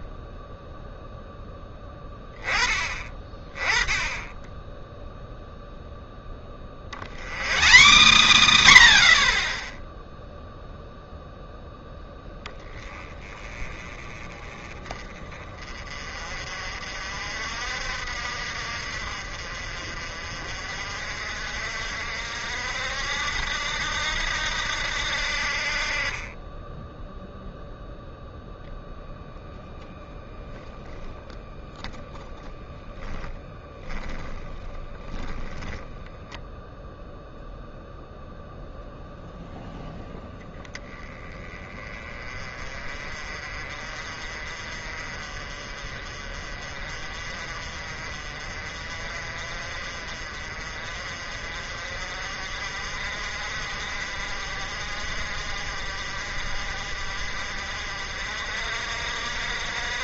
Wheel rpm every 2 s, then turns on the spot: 0, 20, 10, 50, 130, 0, 20, 30, 50, 50, 50, 70, 80, 10, 0, 0, 10, 10, 0, 0, 10, 30, 40, 40, 40, 40, 50, 50, 50, 60.
none